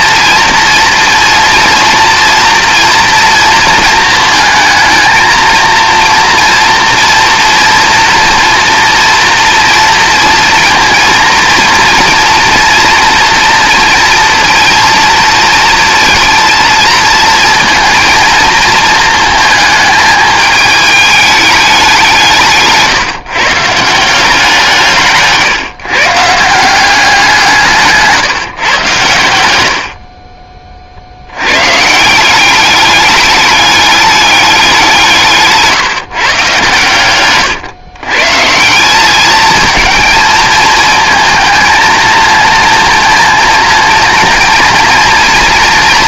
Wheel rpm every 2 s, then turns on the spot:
230, 230, 220, 230, 230, 230, 230, 230, 230, 220, 220, 150, 160, 180, 120, 50, 200, 190, 120, 170, 220, 230, 230.
22-24